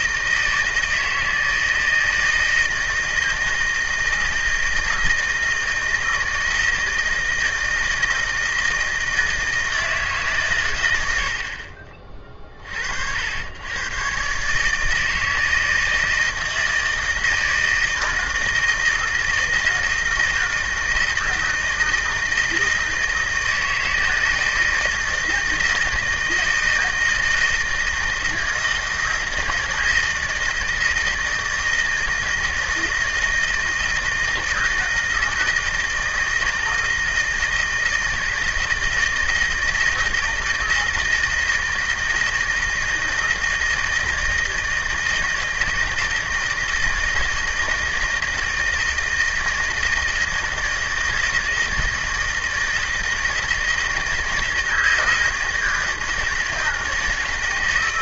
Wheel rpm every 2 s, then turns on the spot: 160, 160, 160, 160, 160, 150, 40, 130, 160, 160, 160, 160, 160, 160, 160, 160, 160, 160, 160, 160, 160, 160, 160, 160, 160, 160, 160, 160, 160.
none